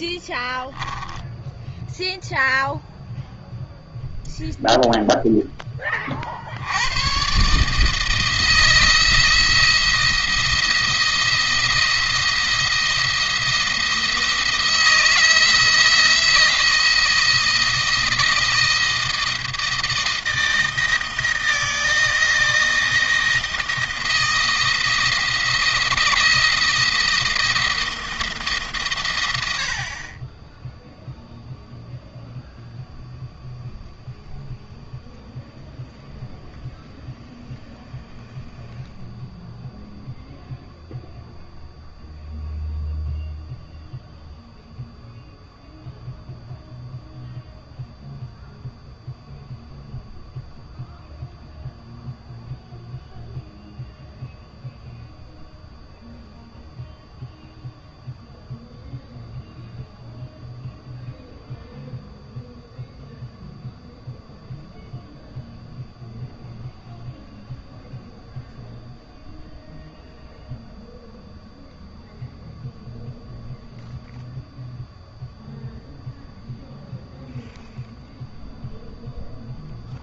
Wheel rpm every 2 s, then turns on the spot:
10, 0, 0, 90, 160, 170, 170, 170, 170, 170, 160, 160, 170, 170, 140, 10, 0, 0, 0, 0, 0, 0, 0, 0, 0, 0, 0, 0, 0, 0, 0, 0, 0, 0, 0, 0, 0, 0, 0, 0.
none